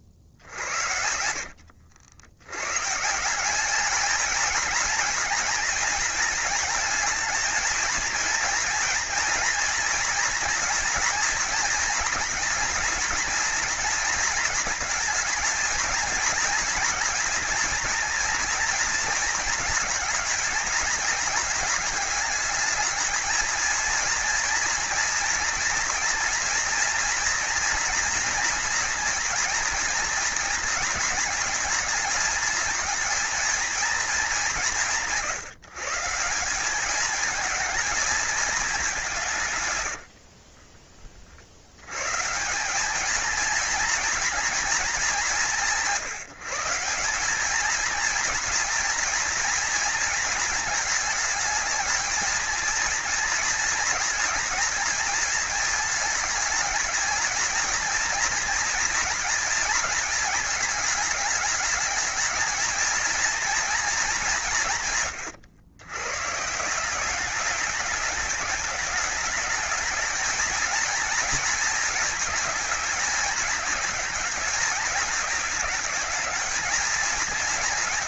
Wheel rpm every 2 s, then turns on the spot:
80, 140, 230, 220, 230, 230, 240, 220, 230, 230, 220, 220, 230, 240, 240, 220, 230, 170, 200, 190, 40, 200, 220, 180, 230, 220, 230, 230, 220, 230, 210, 220, 150, 180, 210, 220, 210, 210, 220.
0-2